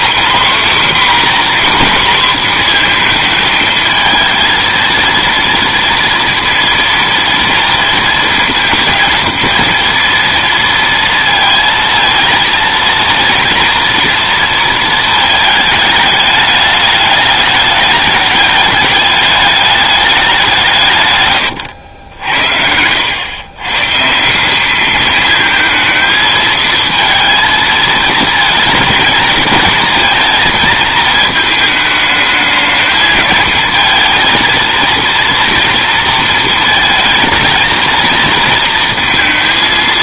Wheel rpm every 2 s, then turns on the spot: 260, 240, 230, 230, 230, 230, 230, 230, 210, 210, 170, 80, 190, 220, 220, 220, 220, 230, 230, 230.
22-24